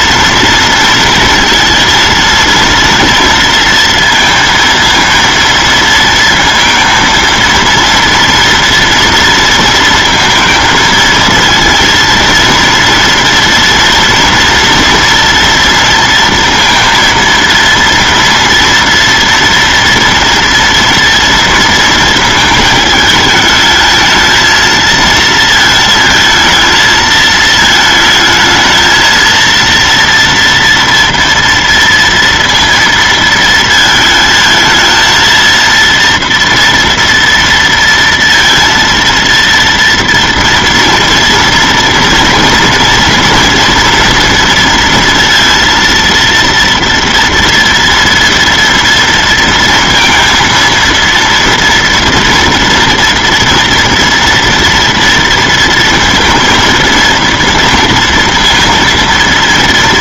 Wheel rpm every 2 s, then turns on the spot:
230, 230, 230, 230, 230, 230, 230, 240, 230, 230, 230, 220, 220, 220, 220, 230, 230, 220, 230, 230, 230, 230, 230, 230, 230, 230, 230, 230, 230, 230.
none